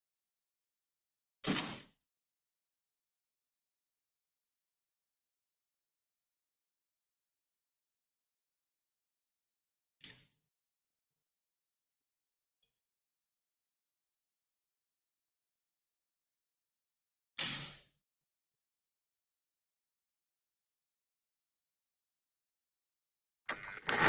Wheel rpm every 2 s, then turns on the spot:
0, 0, 0, 0, 0, 0, 0, 0, 0, 0, 0, 0.
none